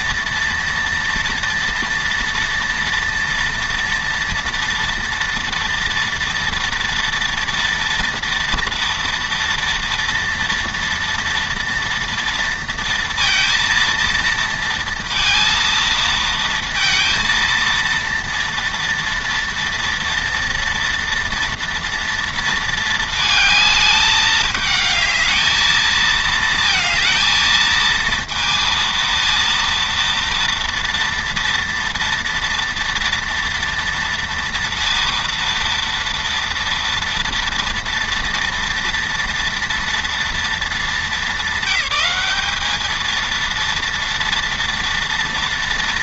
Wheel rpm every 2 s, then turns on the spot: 230, 230, 230, 230, 230, 230, 230, 230, 230, 230, 230, 220, 220, 220, 230, 230, 240, 230, 230, 240, 210, 230, 230.
none